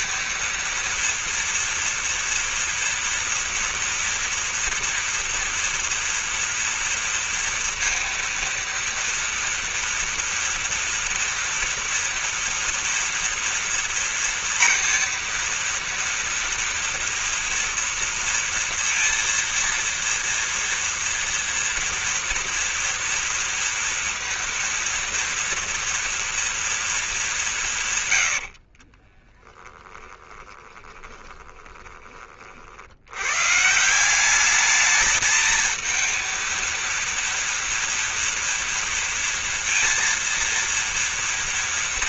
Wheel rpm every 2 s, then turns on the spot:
230, 230, 230, 230, 230, 240, 240, 230, 230, 230, 230, 230, 230, 230, 60, 20, 70, 210, 230, 230, 230.
28-32